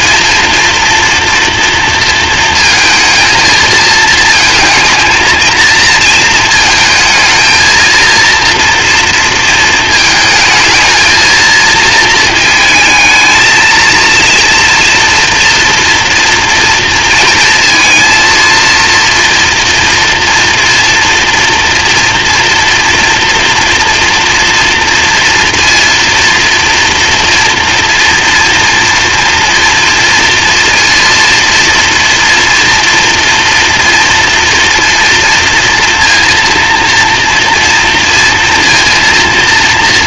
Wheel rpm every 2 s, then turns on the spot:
230, 220, 230, 220, 230, 220, 220, 230, 230, 230, 230, 240, 230, 230, 230, 230, 230, 230, 230, 230.
none